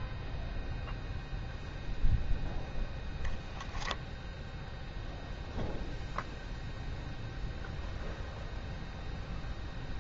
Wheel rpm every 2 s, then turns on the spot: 0, 0, 0, 0, 0.
none